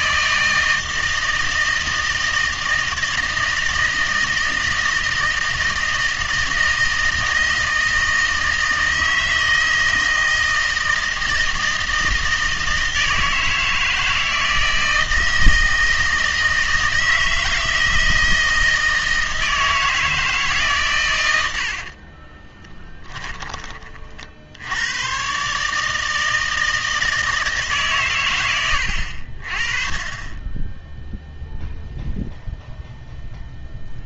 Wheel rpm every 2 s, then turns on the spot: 160, 160, 160, 160, 160, 160, 160, 160, 160, 160, 140, 10, 90, 160, 100, 10, 0.
22-24